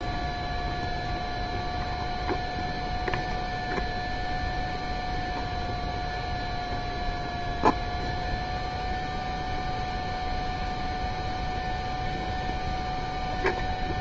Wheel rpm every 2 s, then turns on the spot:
0, 0, 0, 0, 0, 0, 0.
none